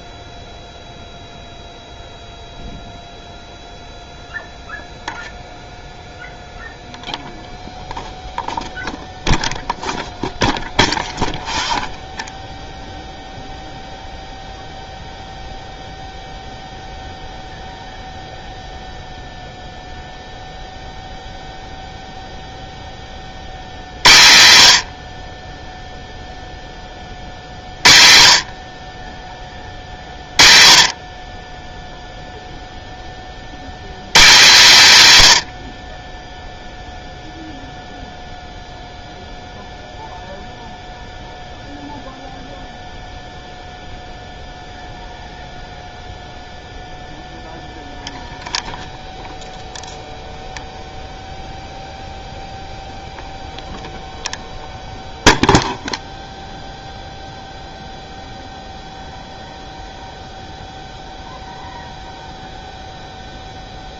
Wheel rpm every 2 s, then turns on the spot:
0, 0, 0, 0, 0, 0, 0, 0, 0, 0, 0, 10, 100, 10, 40, 40, 0, 180, 0, 0, 0, 0, 0, 0, 0, 0, 0, 0, 0, 0, 0, 0.
none